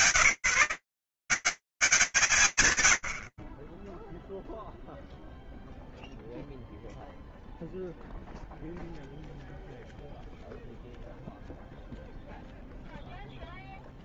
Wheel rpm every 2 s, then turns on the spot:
100, 80, 0, 0, 0, 0, 0.
none